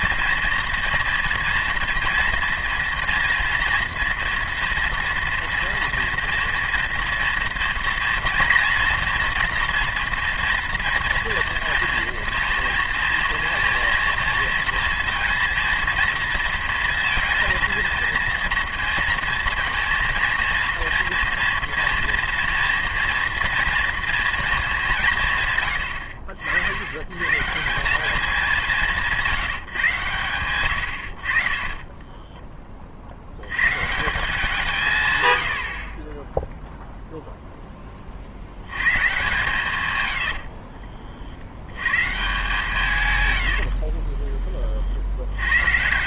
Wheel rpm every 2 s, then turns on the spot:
230, 230, 230, 230, 240, 230, 230, 230, 230, 230, 230, 230, 200, 90, 180, 100, 30, 160, 0, 100, 50, 140, 40.
40-42